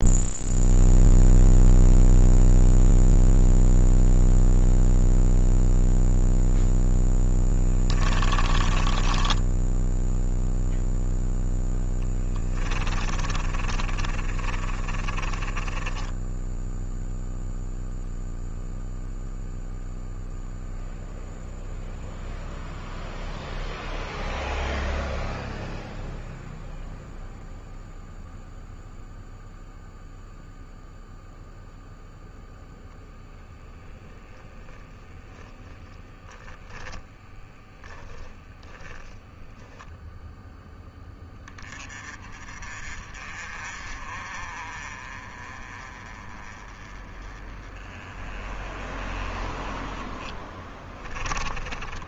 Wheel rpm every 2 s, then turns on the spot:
0, 0, 0, 10, 20, 0, 30, 30, 0, 0, 0, 0, 0, 0, 0, 0, 0, 20, 10, 0, 10, 40, 30, 20, 30, 20.
8-10 12-16 34-38 50-52